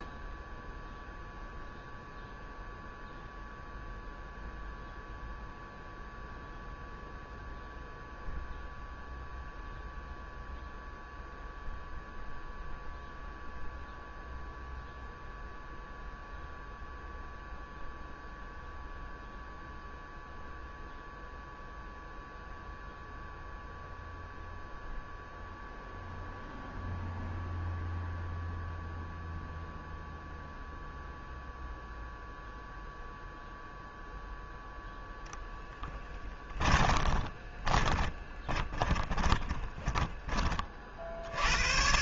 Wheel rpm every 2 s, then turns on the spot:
0, 0, 0, 0, 0, 0, 0, 0, 0, 0, 0, 0, 0, 0, 0, 0, 0, 0, 20, 20, 50.
36-40